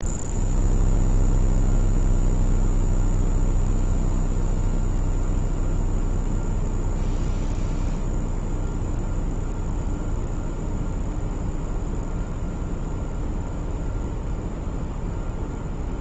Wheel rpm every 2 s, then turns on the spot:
0, 0, 0, 0, 0, 0, 0, 0.
none